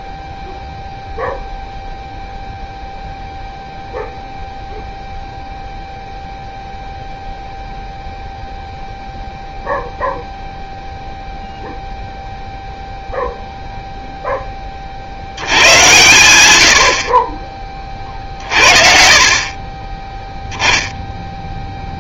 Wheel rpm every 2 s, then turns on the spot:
0, 0, 0, 0, 0, 0, 0, 80, 50, 50, 10.
none